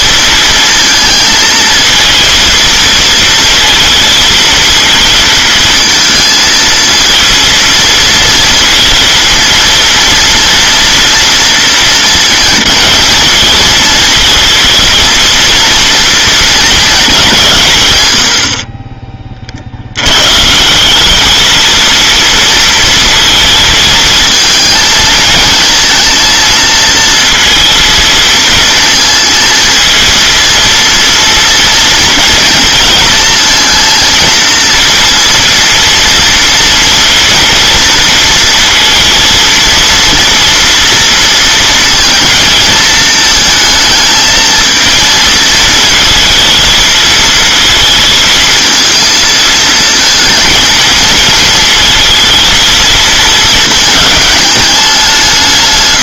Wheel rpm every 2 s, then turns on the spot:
230, 230, 230, 230, 230, 230, 230, 230, 220, 30, 170, 230, 220, 230, 220, 230, 230, 230, 230, 230, 230, 230, 220, 230, 220, 220, 220, 190.
none